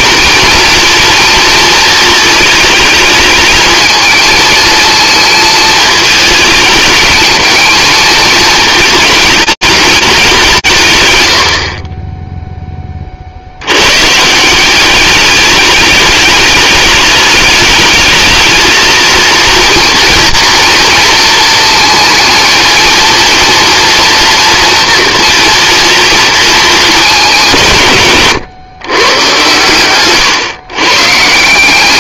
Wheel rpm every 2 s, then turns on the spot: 230, 220, 220, 220, 220, 140, 10, 190, 210, 220, 230, 230, 240, 220, 120, 130.
none